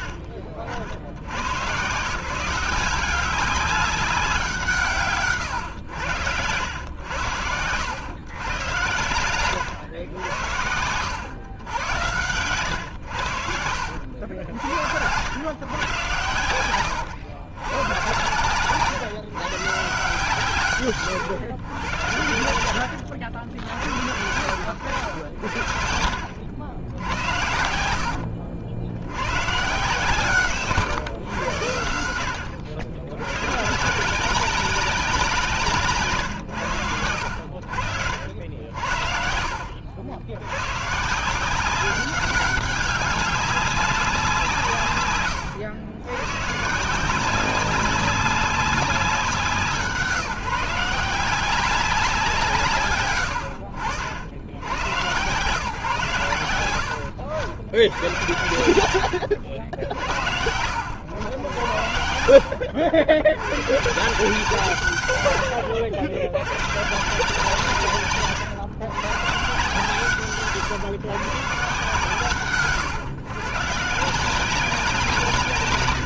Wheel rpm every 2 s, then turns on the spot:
70, 180, 160, 100, 120, 90, 110, 80, 110, 140, 130, 80, 90, 90, 100, 130, 100, 180, 80, 60, 130, 200, 120, 150, 190, 160, 140, 100, 80, 100, 90, 80, 130, 130, 120, 140, 140, 170.
22-26 58-60